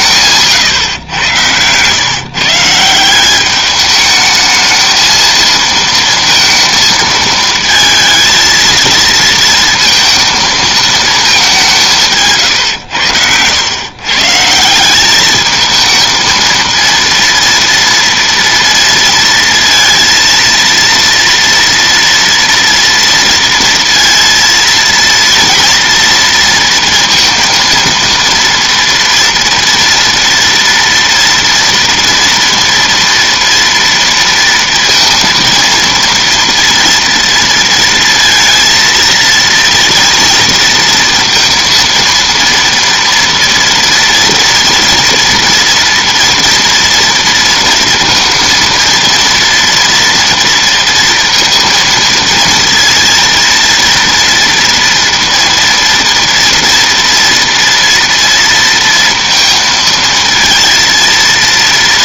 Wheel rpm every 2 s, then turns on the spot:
140, 160, 220, 230, 230, 220, 130, 170, 230, 230, 230, 230, 230, 230, 230, 230, 230, 230, 230, 230, 230, 230, 230, 230, 230, 230, 230, 230, 230, 230, 230.
0-2